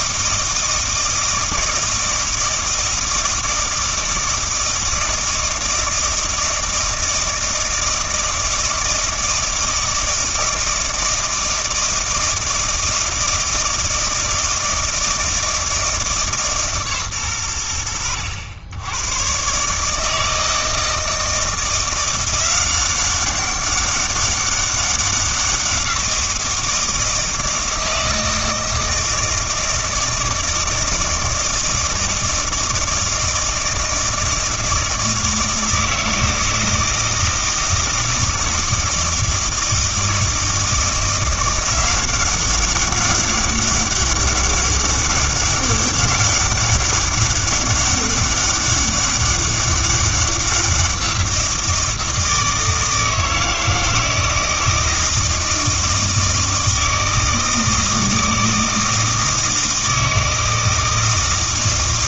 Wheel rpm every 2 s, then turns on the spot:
160, 160, 160, 160, 160, 160, 160, 160, 140, 90, 160, 190, 200, 170, 160, 160, 160, 160, 160, 160, 170, 190, 200, 200, 200, 180, 160, 160, 160, 160, 160.
none